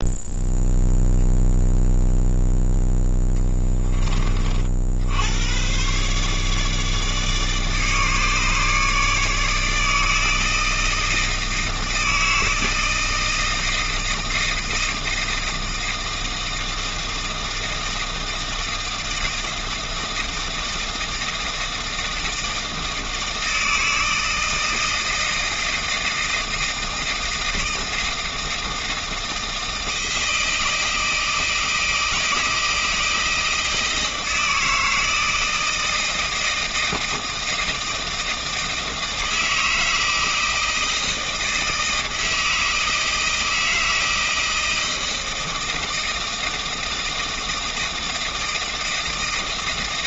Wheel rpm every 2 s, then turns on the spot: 0, 10, 70, 150, 150, 160, 160, 160, 160, 160, 160, 160, 160, 160, 160, 160, 160, 160, 160, 160, 170, 160, 160, 160, 160.
none